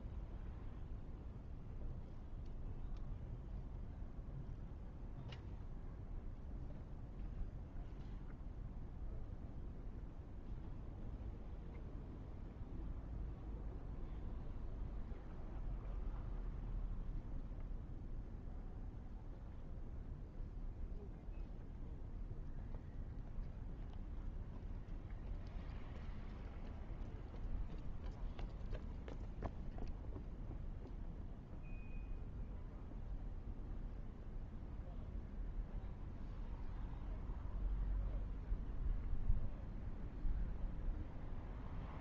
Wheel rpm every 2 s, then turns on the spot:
0, 0, 0, 0, 0, 0, 0, 0, 0, 0, 0, 0, 0, 0, 0, 0, 0, 0, 0, 0, 0.
none